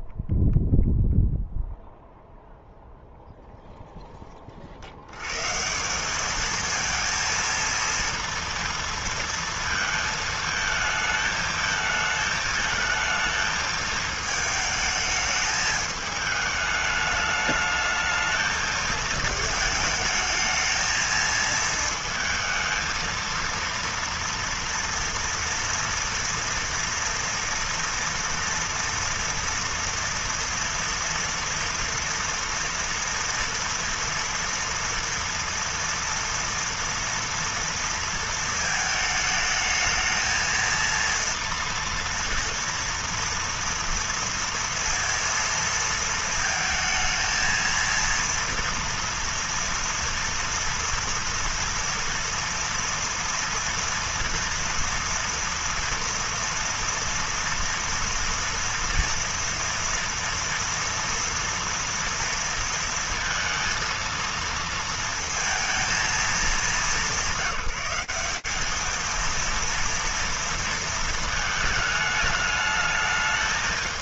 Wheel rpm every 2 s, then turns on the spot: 0, 0, 30, 210, 230, 220, 220, 220, 220, 220, 220, 220, 230, 230, 230, 230, 240, 230, 230, 220, 220, 230, 230, 230, 230, 230, 230, 230, 230, 230, 230, 230, 230, 210, 210, 230, 210.
none